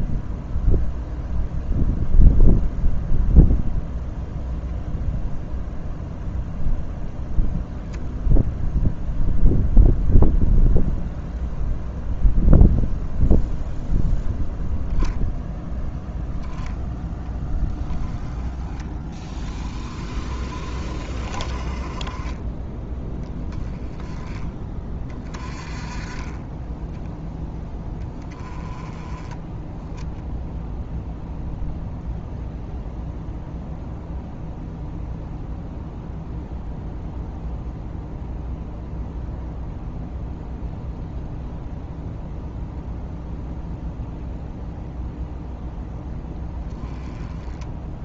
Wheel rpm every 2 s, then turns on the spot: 0, 0, 0, 10, 0, 0, 0, 0, 10, 20, 40, 10, 30, 10, 20, 0, 0, 0, 0, 0, 0, 0, 0, 10.
none